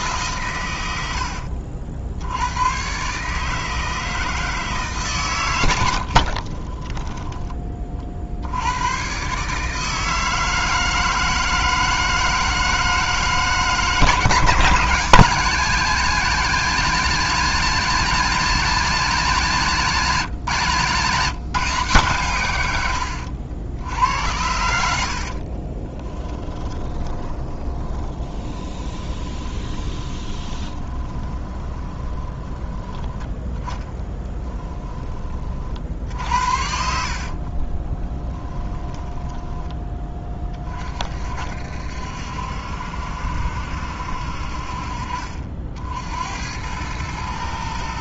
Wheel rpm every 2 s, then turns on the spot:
110, 110, 160, 40, 90, 160, 160, 150, 190, 190, 140, 100, 70, 20, 20, 20, 30, 20, 70, 10, 40, 70, 50, 90.
6-8 24-40